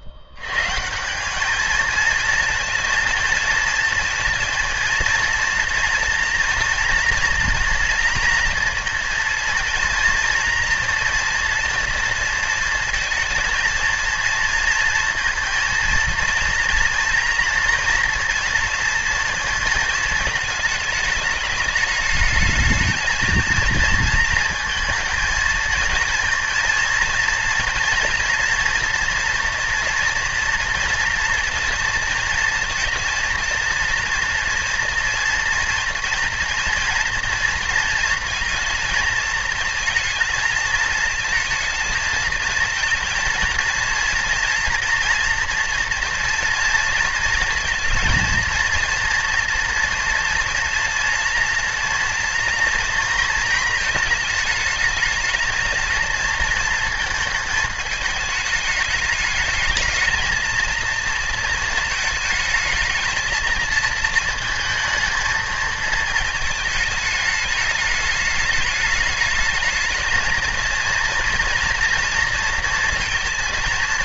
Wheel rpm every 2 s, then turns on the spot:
90, 230, 230, 240, 230, 230, 230, 230, 230, 230, 210, 220, 230, 230, 230, 230, 230, 230, 230, 220, 230, 230, 240, 230, 230, 230, 230, 220, 230, 210, 230, 220, 220, 220, 210, 230, 230.
none